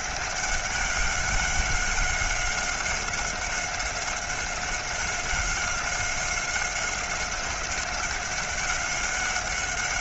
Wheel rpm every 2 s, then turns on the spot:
200, 190, 190, 190, 190.
none